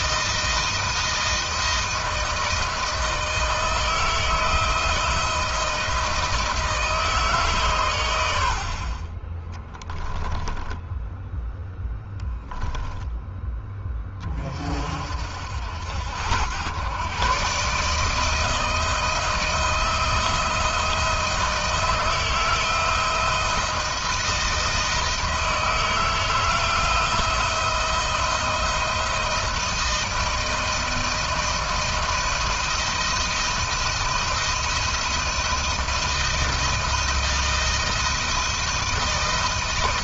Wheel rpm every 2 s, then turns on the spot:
160, 160, 160, 160, 50, 10, 10, 50, 110, 160, 160, 160, 160, 160, 170, 170, 170, 170, 160, 160.
none